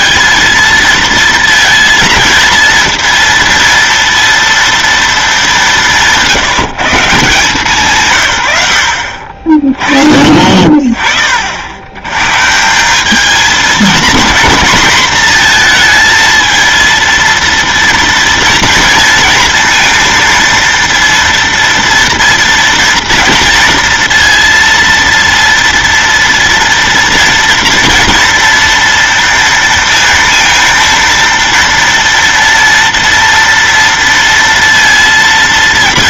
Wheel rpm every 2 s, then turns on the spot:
230, 230, 230, 160, 90, 30, 170, 240, 230, 230, 230, 230, 230, 240, 230, 230, 230, 230.
none